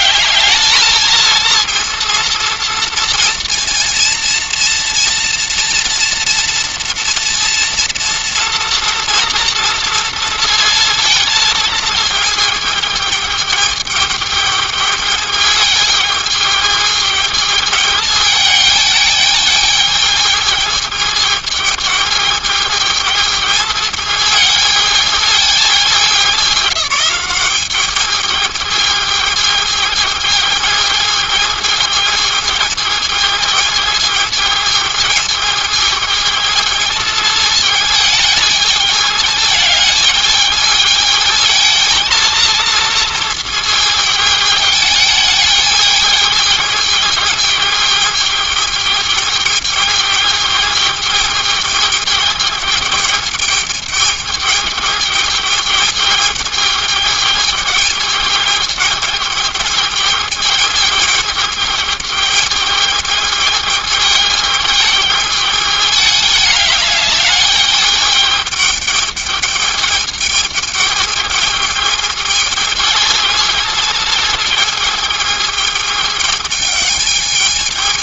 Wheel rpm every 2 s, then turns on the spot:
220, 230, 230, 230, 230, 230, 220, 210, 220, 210, 220, 210, 220, 200, 220, 220, 220, 220, 220, 210, 220, 230, 210, 210, 210, 210, 210, 210, 210, 210, 210, 210, 210, 210, 210, 210, 220, 220, 210.
none